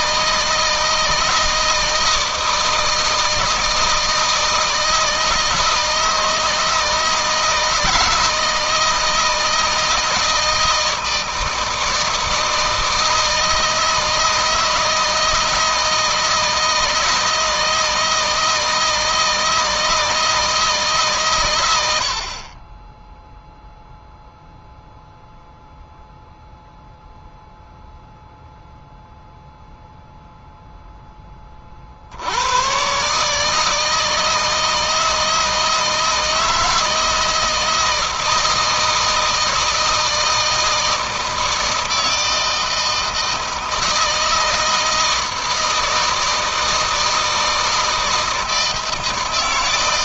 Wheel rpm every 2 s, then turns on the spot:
160, 160, 160, 160, 160, 160, 160, 160, 160, 160, 140, 10, 0, 0, 0, 10, 130, 160, 160, 160, 160, 160, 160, 160, 160.
none